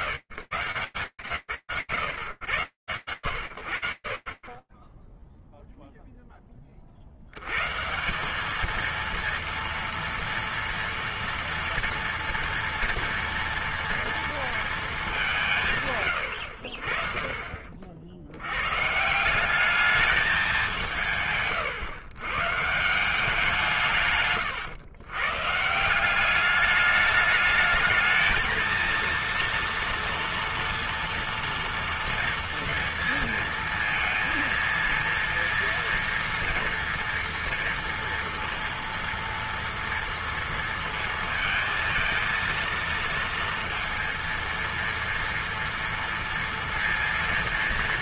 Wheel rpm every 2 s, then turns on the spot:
140, 100, 10, 50, 220, 240, 230, 190, 50, 180, 150, 170, 140, 210, 230, 230, 230, 230, 230, 230, 230, 230, 230, 230.
20-22